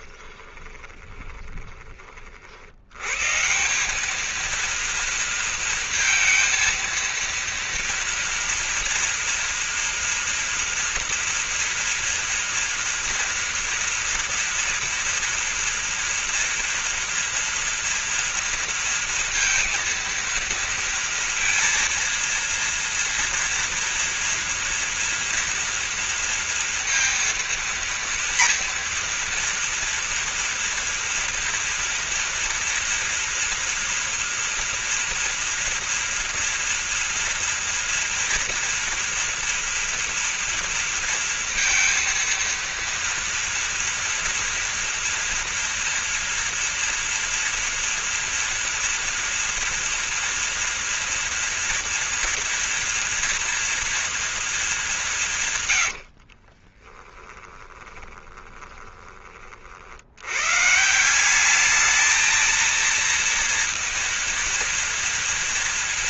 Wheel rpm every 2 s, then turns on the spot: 20, 90, 230, 230, 230, 230, 230, 230, 230, 230, 230, 240, 230, 230, 230, 230, 240, 240, 240, 230, 230, 230, 240, 230, 240, 230, 230, 200, 20, 20, 160, 230, 230.
0-2 56-58